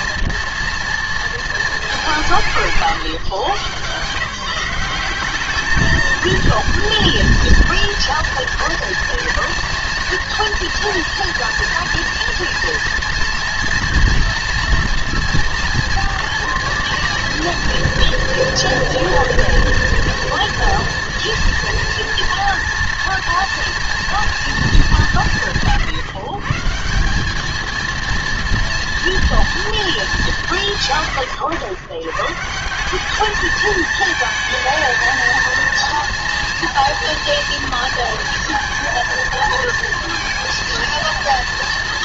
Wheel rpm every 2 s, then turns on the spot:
240, 150, 170, 230, 230, 230, 240, 230, 230, 230, 230, 230, 220, 150, 230, 170, 160, 220, 230, 230, 230.
none